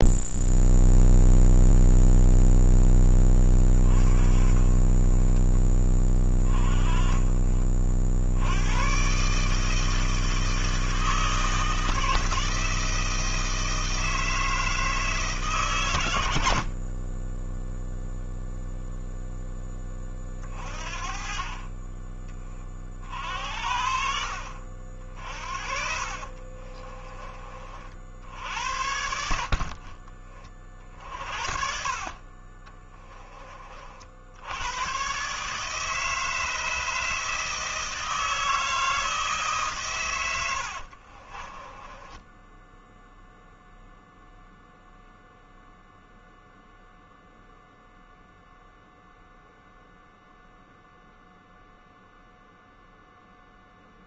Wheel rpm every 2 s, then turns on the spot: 0, 10, 30, 20, 120, 160, 160, 160, 40, 0, 30, 40, 60, 40, 70, 40, 20, 110, 160, 160, 60, 0, 0, 0, 0, 0, 0.
26-28 32-34 40-42